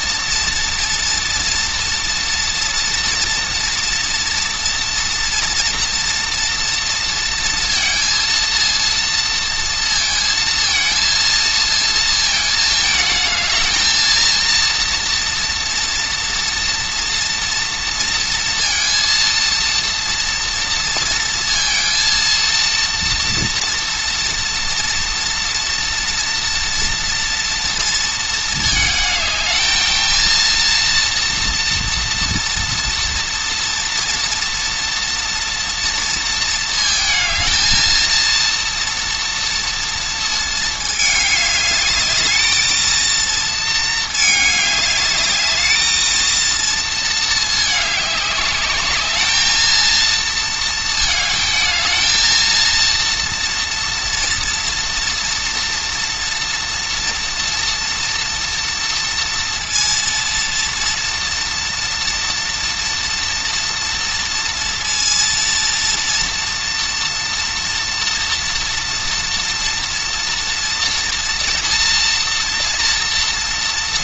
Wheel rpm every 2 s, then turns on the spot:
230, 230, 230, 230, 230, 230, 220, 230, 230, 230, 230, 230, 230, 230, 220, 230, 240, 240, 230, 230, 220, 220, 210, 230, 210, 220, 230, 230, 230, 230, 230, 230, 230, 230, 230, 230, 230.
none